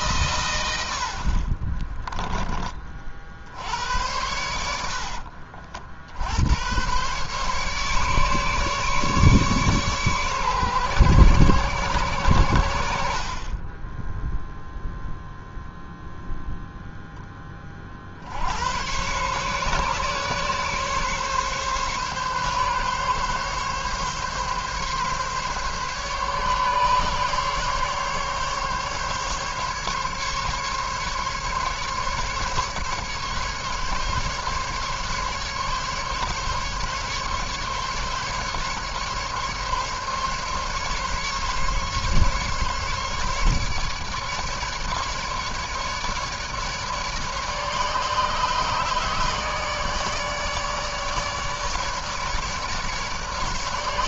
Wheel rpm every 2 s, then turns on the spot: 80, 30, 70, 110, 150, 130, 70, 0, 0, 100, 140, 140, 140, 140, 140, 140, 140, 140, 140, 140, 140, 140, 150, 150, 150, 150, 150.
none